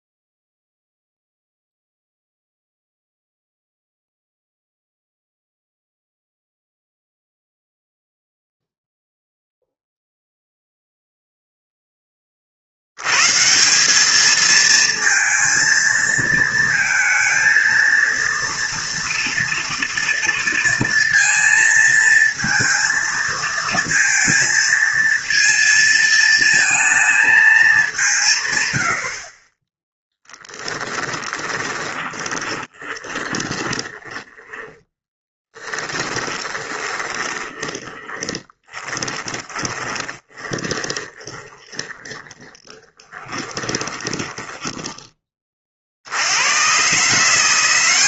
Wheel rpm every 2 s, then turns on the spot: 0, 0, 0, 0, 0, 0, 70, 230, 230, 230, 230, 230, 230, 230, 110, 10, 10, 10, 20, 20, 20, 30, 10, 110.
30-46